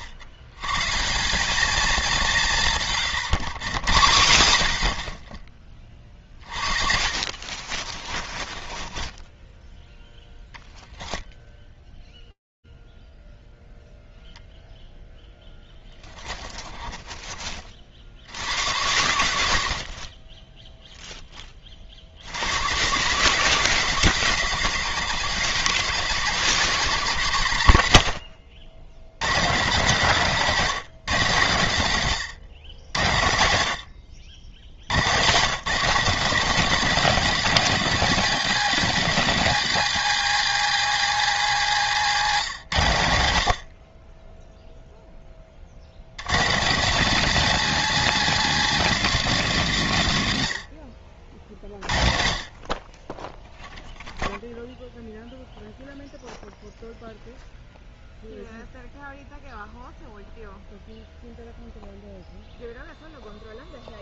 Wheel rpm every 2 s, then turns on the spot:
100, 160, 80, 50, 30, 0, 0, 0, 40, 90, 10, 130, 170, 150, 110, 150, 80, 130, 230, 240, 230, 100, 10, 210, 220, 50, 10, 0, 0, 0, 0, 0.
2-4 6-10 16-18